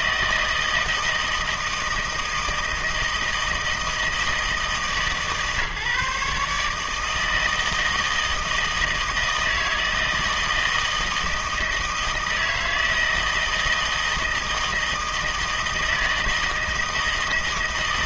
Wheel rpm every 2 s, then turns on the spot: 160, 160, 150, 150, 160, 160, 160, 160, 160.
none